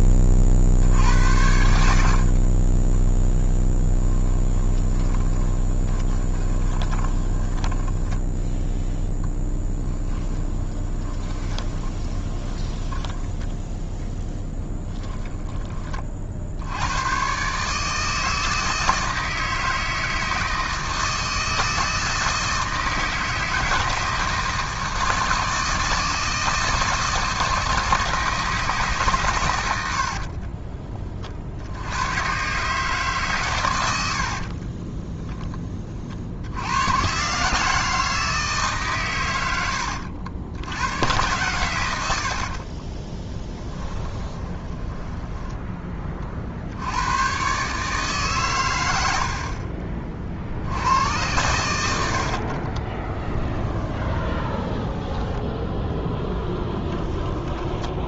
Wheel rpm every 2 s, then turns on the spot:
40, 20, 20, 20, 10, 10, 10, 10, 90, 160, 160, 160, 160, 160, 150, 30, 140, 40, 100, 140, 90, 40, 20, 80, 100, 80, 40, 10, 10.
4-8 10-16 34-36 42-46 52-58